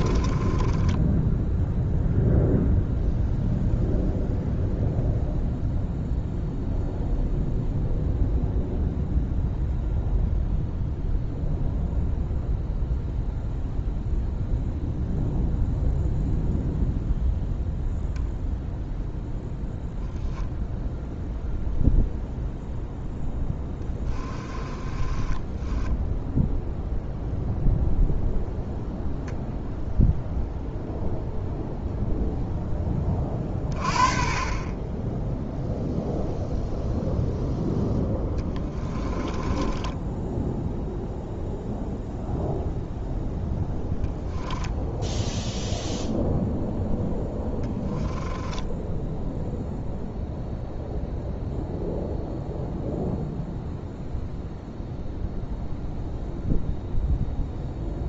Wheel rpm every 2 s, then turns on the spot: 10, 0, 0, 0, 0, 0, 0, 0, 0, 0, 0, 0, 20, 0, 0, 0, 20, 20, 0, 20, 0, 0, 0, 0, 10, 0, 0, 0, 0.
0-2 24-26 38-40 48-50